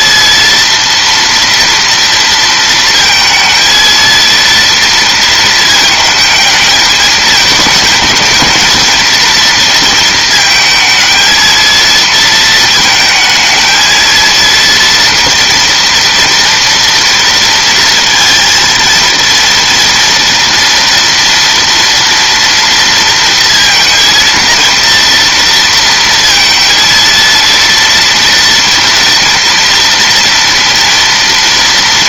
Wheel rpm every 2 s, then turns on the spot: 230, 230, 230, 220, 220, 220, 220, 230, 230, 230, 240, 230, 230, 230, 230, 230.
none